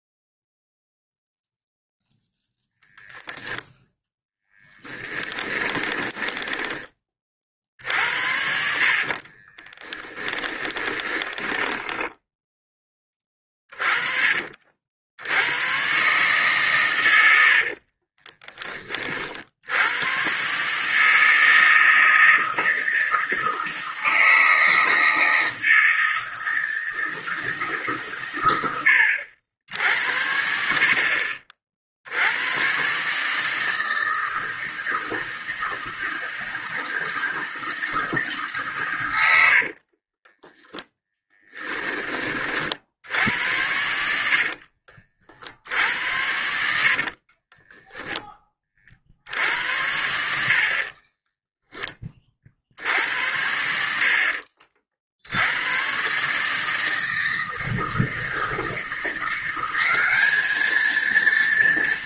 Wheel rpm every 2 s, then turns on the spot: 0, 0, 10, 20, 60, 10, 10, 50, 130, 20, 130, 160, 160, 160, 110, 60, 110, 160, 160, 140, 10, 40, 60, 70, 20, 70, 50, 50, 150, 160, 210.
4-6 8-12 18-20 40-42 44-48 50-52